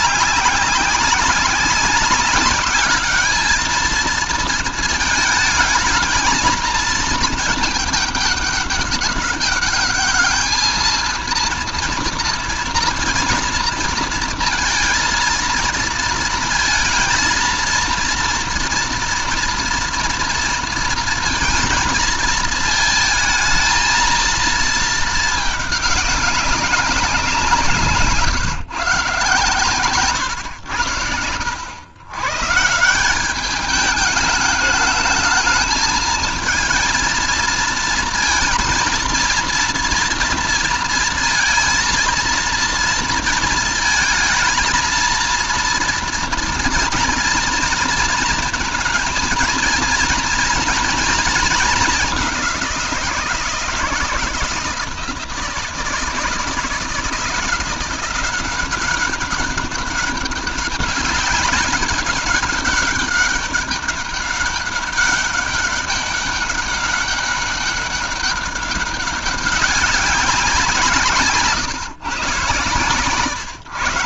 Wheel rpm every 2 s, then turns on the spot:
200, 200, 220, 220, 210, 220, 230, 230, 230, 230, 230, 220, 220, 190, 150, 100, 170, 220, 230, 230, 230, 230, 230, 230, 220, 230, 180, 170, 170, 190, 200, 200, 200, 200, 200, 160, 130.
none